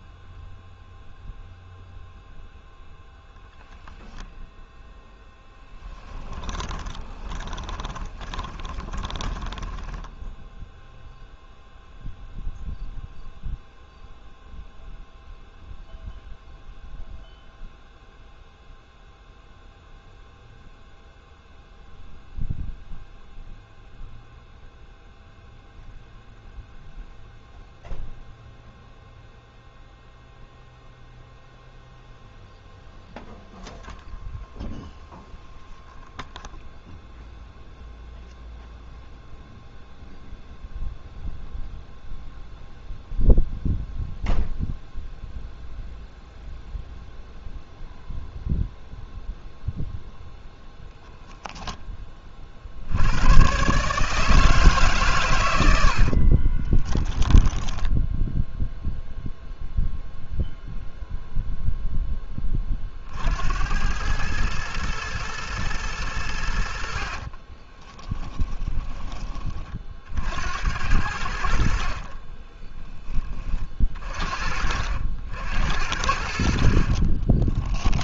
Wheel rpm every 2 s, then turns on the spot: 0, 0, 0, 20, 20, 0, 0, 0, 0, 0, 0, 0, 0, 0, 0, 0, 0, 0, 0, 0, 0, 0, 0, 0, 0, 0, 60, 140, 20, 0, 0, 30, 110, 70, 10, 80, 10, 50, 50.
6-10 56-58 68-70 72-74